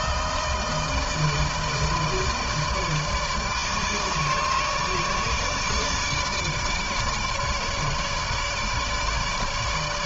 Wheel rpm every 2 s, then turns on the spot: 160, 150, 150, 150, 150.
none